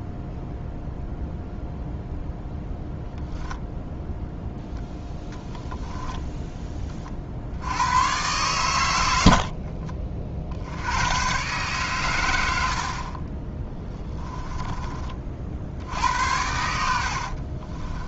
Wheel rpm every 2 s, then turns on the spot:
0, 0, 0, 20, 100, 80, 60, 20, 70.
16-18